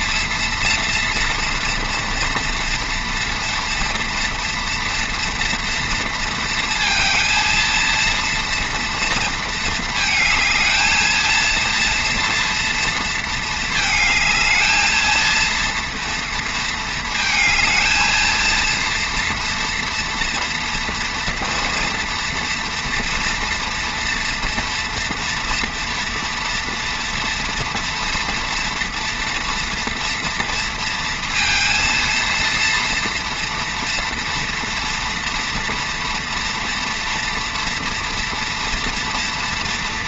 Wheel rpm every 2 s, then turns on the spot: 230, 230, 230, 230, 230, 220, 230, 220, 230, 230, 230, 230, 230, 240, 230, 230, 230, 240, 240, 230.
none